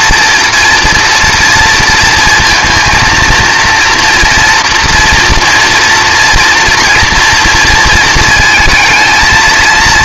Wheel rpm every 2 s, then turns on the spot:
240, 230, 230, 240, 220.
none